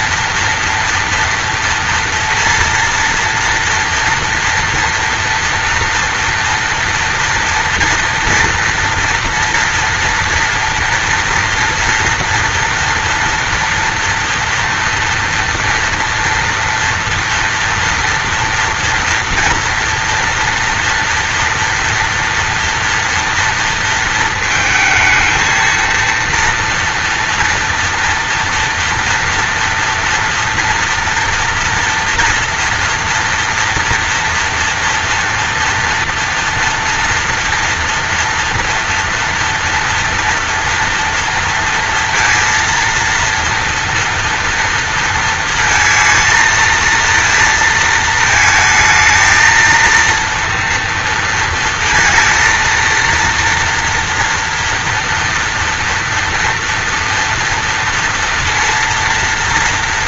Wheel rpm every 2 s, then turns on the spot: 230, 230, 230, 240, 230, 240, 230, 230, 230, 230, 230, 230, 230, 230, 230, 240, 230, 230, 230, 230, 230, 230, 230, 230, 220, 230, 230, 240, 230, 230.
none